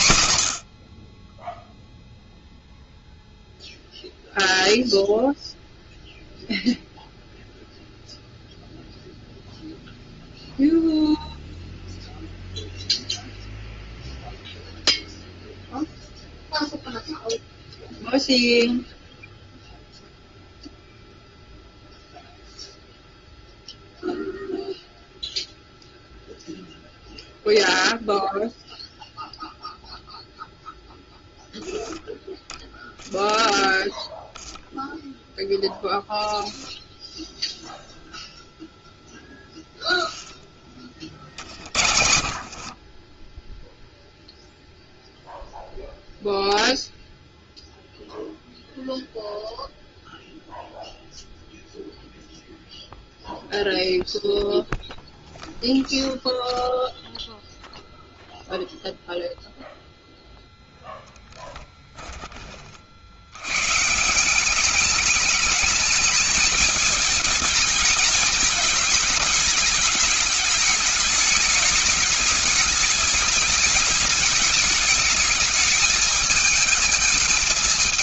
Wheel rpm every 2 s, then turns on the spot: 50, 0, 0, 0, 0, 0, 0, 0, 0, 0, 0, 0, 0, 0, 0, 0, 10, 10, 10, 0, 40, 60, 0, 0, 0, 0, 0, 0, 0, 0, 0, 50, 200, 220, 220, 210, 210, 210, 220.
40-44